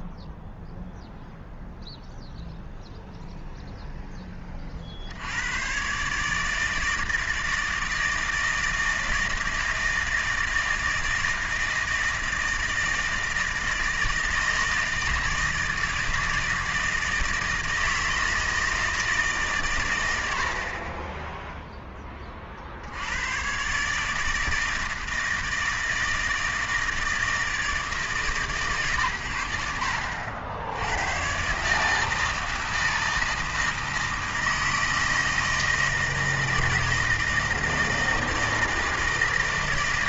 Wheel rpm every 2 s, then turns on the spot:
0, 0, 40, 150, 160, 160, 160, 160, 160, 160, 50, 60, 160, 160, 130, 80, 160, 160, 160, 160.
none